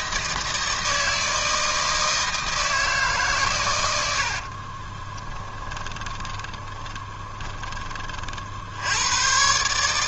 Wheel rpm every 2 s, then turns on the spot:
160, 160, 70, 20, 50.
4-8